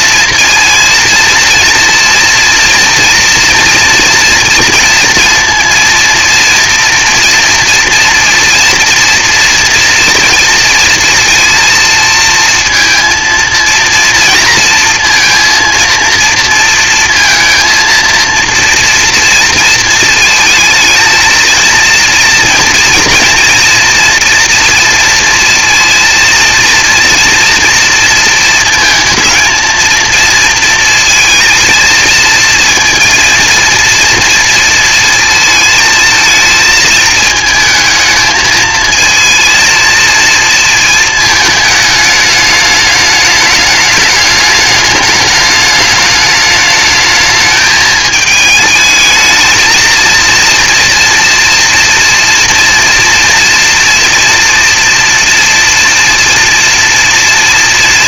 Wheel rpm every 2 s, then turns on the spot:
230, 230, 230, 230, 240, 230, 230, 230, 230, 230, 220, 230, 230, 230, 220, 230, 220, 230, 220, 220, 230, 210, 210, 210, 220, 230, 240, 240, 230.
none